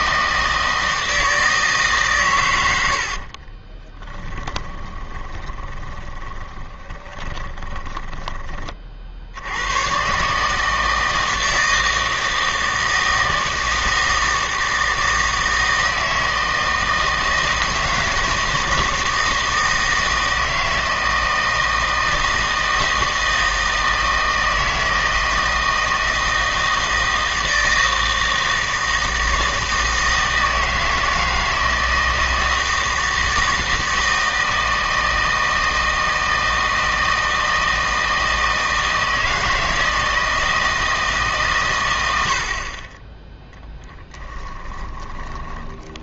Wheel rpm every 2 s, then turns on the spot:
160, 110, 20, 20, 30, 150, 160, 160, 160, 160, 160, 160, 160, 160, 160, 160, 160, 160, 160, 160, 160, 50, 20.
4-8 44-46